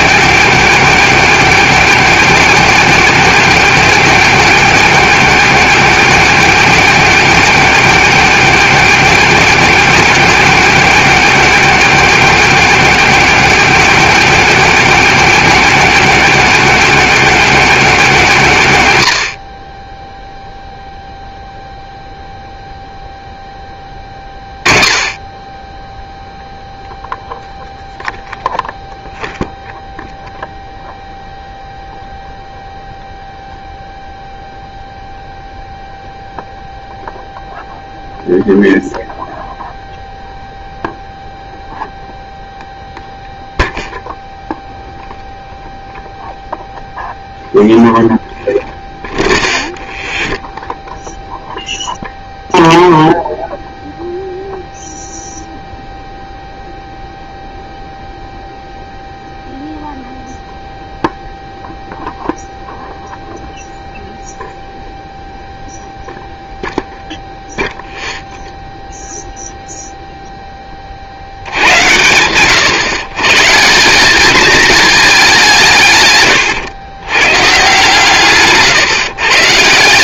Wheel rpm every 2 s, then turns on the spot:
280, 280, 280, 280, 280, 280, 270, 280, 280, 210, 0, 0, 20, 0, 0, 0, 0, 0, 0, 0, 0, 0, 0, 0, 0, 0, 0, 0, 0, 0, 0, 0, 0, 0, 0, 10, 110, 210, 120, 150.
none